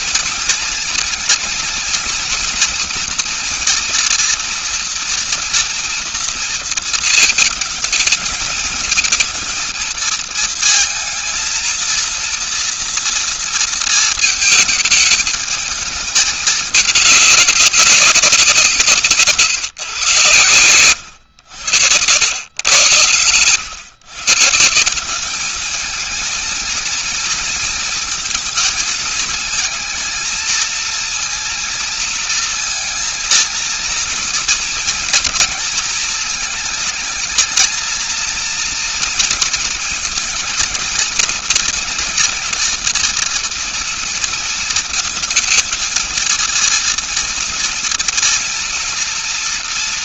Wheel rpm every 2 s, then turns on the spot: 220, 230, 230, 230, 220, 220, 230, 220, 210, 180, 110, 100, 160, 220, 230, 230, 230, 230, 220, 230, 230, 230, 230, 230, 230.
none